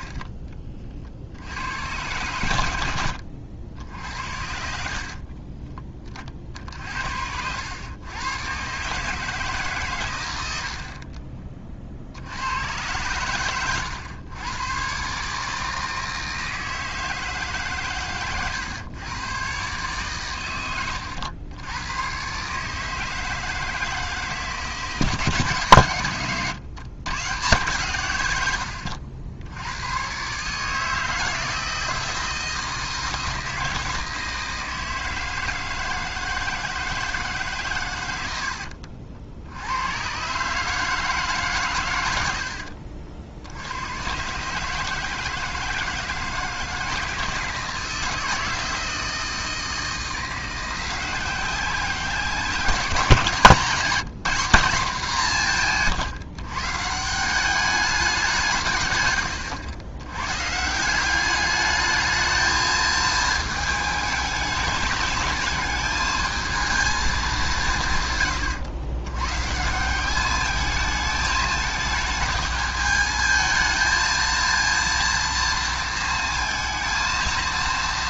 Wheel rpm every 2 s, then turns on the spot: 50, 100, 50, 60, 120, 60, 100, 130, 160, 120, 110, 150, 150, 110, 100, 150, 160, 160, 160, 70, 140, 70, 150, 160, 160, 170, 190, 200, 140, 160, 150, 220, 210, 220, 110, 210, 220, 230, 230.
38-40